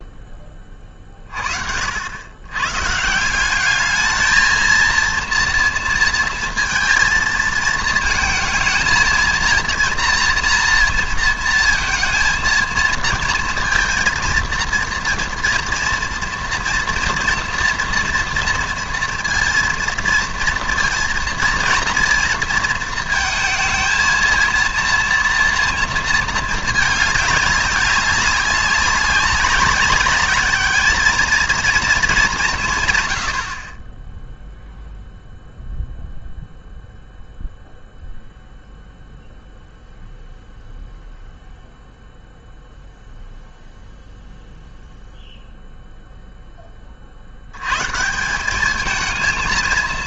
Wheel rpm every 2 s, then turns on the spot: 20, 120, 220, 230, 230, 230, 230, 230, 230, 230, 230, 230, 230, 220, 200, 210, 160, 0, 0, 0, 0, 0, 0, 20, 200.
none